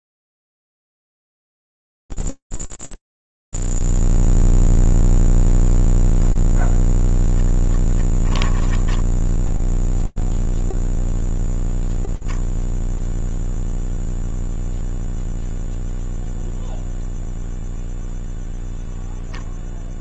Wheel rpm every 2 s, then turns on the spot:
0, 0, 0, 0, 10, 0, 0, 0, 0, 0.
8-10